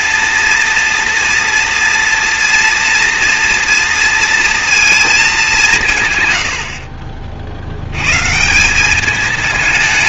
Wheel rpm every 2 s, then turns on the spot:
230, 230, 230, 110, 140.
none